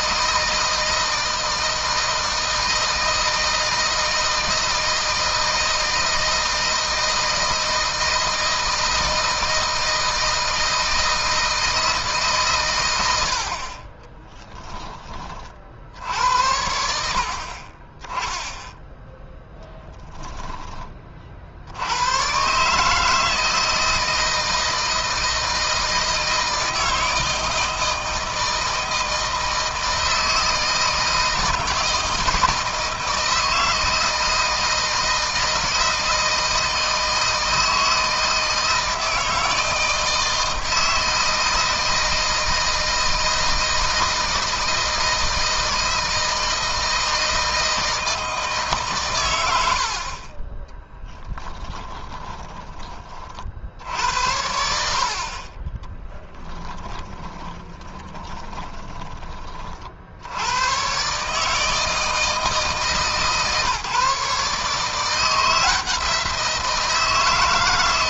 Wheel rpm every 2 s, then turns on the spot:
160, 160, 160, 160, 160, 160, 100, 20, 90, 10, 30, 150, 160, 160, 160, 160, 160, 160, 160, 160, 160, 160, 160, 160, 130, 10, 30, 70, 10, 20, 120, 160, 160, 170.
50-52 56-58